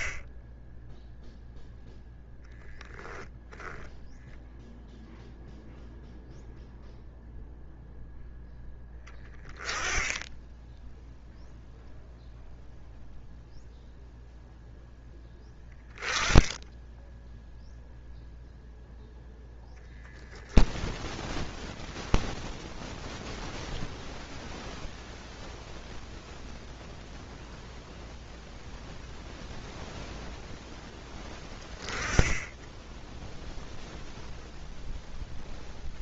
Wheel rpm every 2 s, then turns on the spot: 20, 10, 0, 0, 0, 10, 0, 0, 10, 0, 0, 0, 0, 0, 0, 0, 10, 0.
none